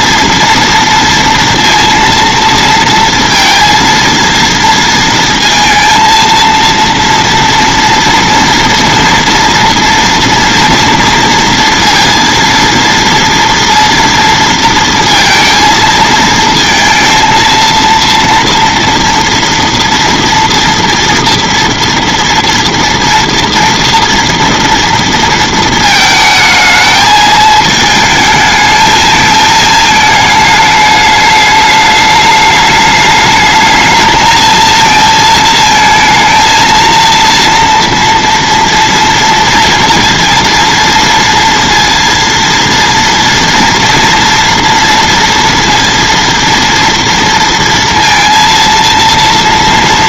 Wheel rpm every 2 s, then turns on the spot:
230, 230, 230, 230, 230, 230, 230, 230, 220, 240, 230, 230, 230, 220, 220, 210, 210, 230, 230, 230, 230, 230, 230, 230, 230.
none